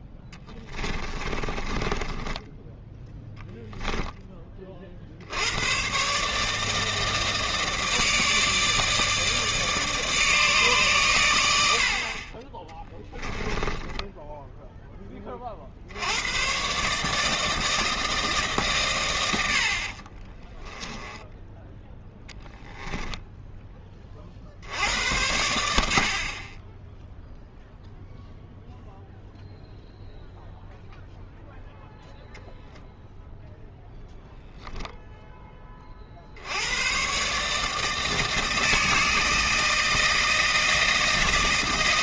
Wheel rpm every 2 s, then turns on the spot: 10, 10, 30, 150, 160, 140, 20, 0, 130, 140, 10, 10, 60, 20, 0, 0, 0, 0, 80, 160, 160.
0-4 20-24